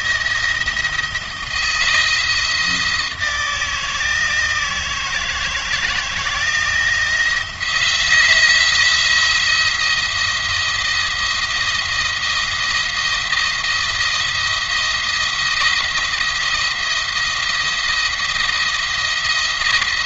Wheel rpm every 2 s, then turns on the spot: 170, 160, 160, 170, 170, 170, 160, 170, 170, 170.
none